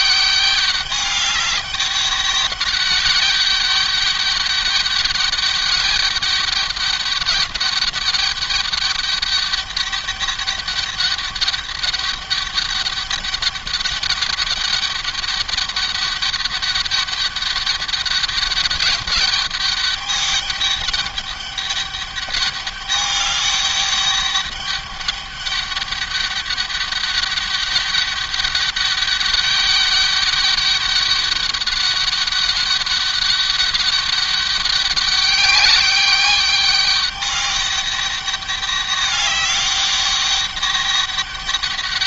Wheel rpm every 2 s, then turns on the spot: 200, 200, 200, 210, 200, 200, 200, 200, 200, 200, 200, 200, 200, 200, 200, 200, 200, 200, 200, 200, 200.
none